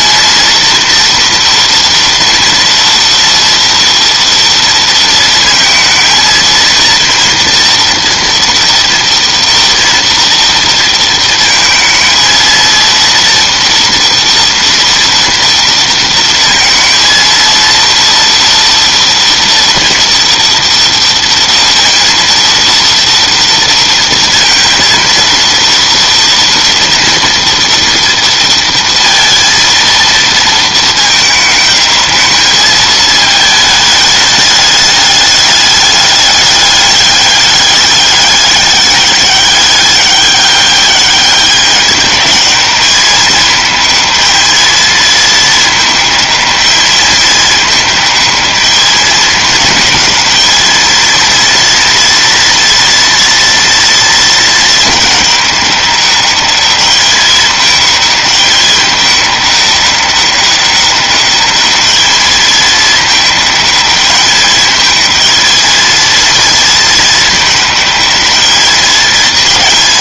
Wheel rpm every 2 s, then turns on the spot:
230, 230, 230, 230, 230, 230, 230, 240, 230, 230, 230, 230, 230, 230, 230, 220, 220, 210, 200, 200, 200, 210, 220, 220, 210, 220, 230, 220, 210, 210, 200, 210, 220, 230, 220.
none